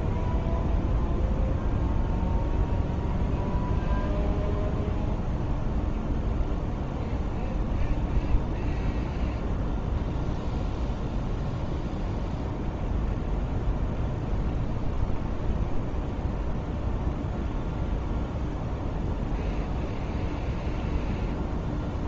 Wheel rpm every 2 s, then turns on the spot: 0, 0, 0, 0, 0, 0, 0, 0, 0, 0, 0.
none